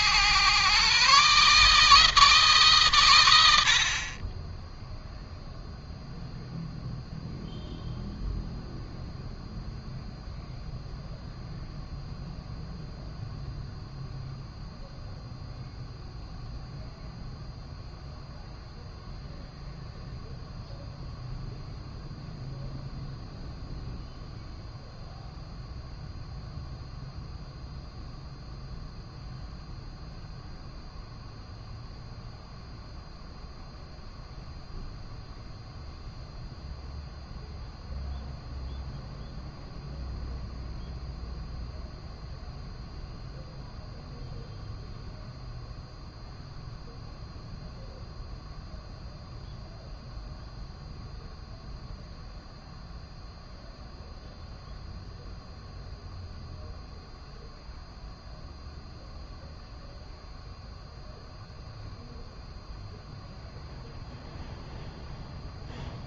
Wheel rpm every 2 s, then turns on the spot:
130, 130, 0, 0, 0, 0, 0, 0, 0, 0, 0, 0, 0, 0, 0, 0, 0, 0, 0, 0, 0, 0, 0, 0, 0, 0, 0, 0, 0, 0, 0, 0, 0.
none